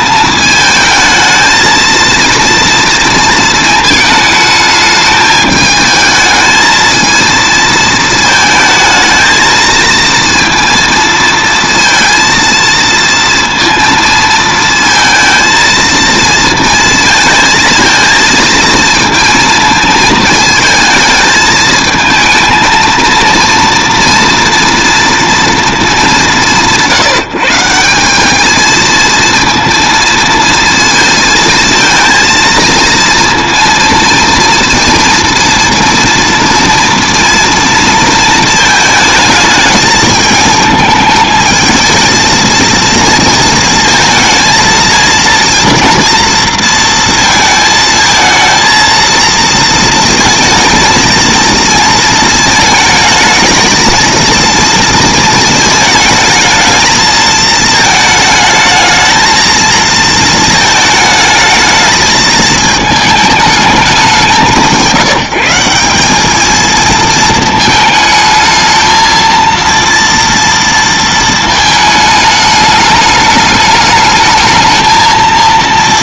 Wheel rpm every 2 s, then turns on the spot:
220, 230, 220, 220, 220, 230, 230, 220, 230, 230, 220, 220, 230, 140, 220, 230, 230, 230, 230, 220, 220, 220, 220, 230, 230, 220, 220, 230, 220, 220, 220, 220, 170, 220, 220, 230, 210, 220.
none